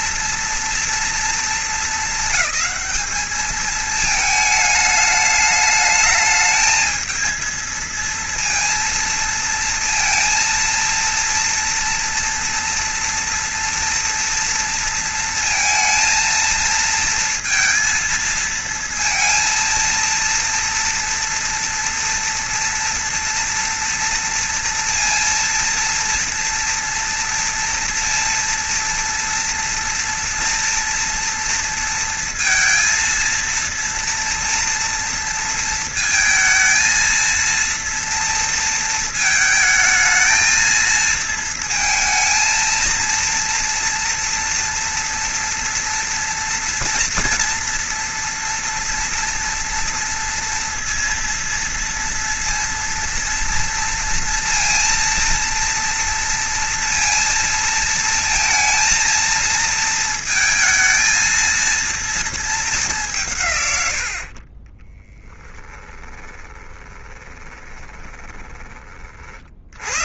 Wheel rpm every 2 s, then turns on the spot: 240, 210, 220, 220, 230, 220, 230, 230, 220, 230, 230, 230, 230, 230, 230, 230, 230, 230, 230, 230, 220, 220, 230, 240, 240, 230, 230, 230, 230, 230, 230, 220, 40, 20, 20.
66-70